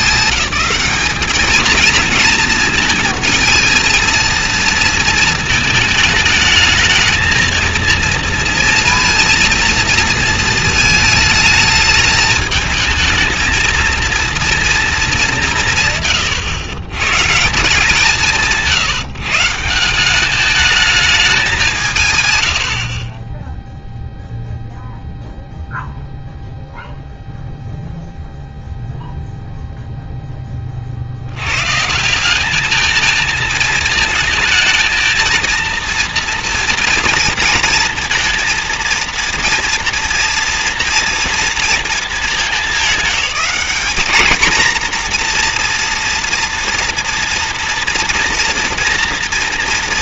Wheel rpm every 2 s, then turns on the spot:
210, 220, 230, 220, 230, 220, 220, 230, 120, 160, 210, 70, 0, 0, 0, 70, 220, 230, 230, 230, 230, 190, 240, 230, 230.
none